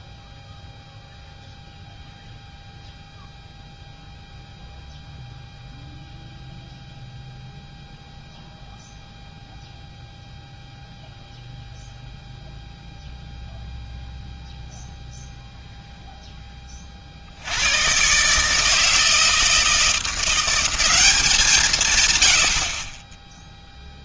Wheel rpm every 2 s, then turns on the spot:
0, 0, 0, 0, 0, 0, 0, 0, 20, 150, 180, 90.
none